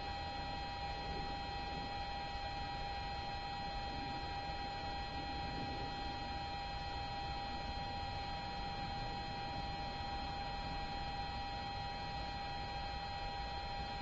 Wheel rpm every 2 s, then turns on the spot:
0, 0, 0, 0, 0, 0, 0.
none